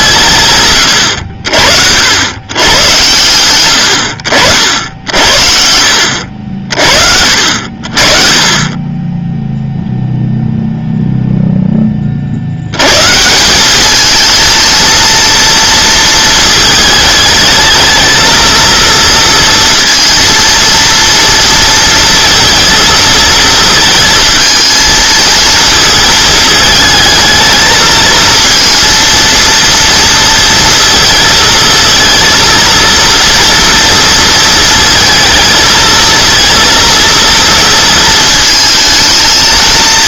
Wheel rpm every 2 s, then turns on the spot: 120, 120, 60, 50, 20, 0, 100, 230, 220, 230, 230, 230, 220, 220, 230, 230, 230, 230, 230, 220.
none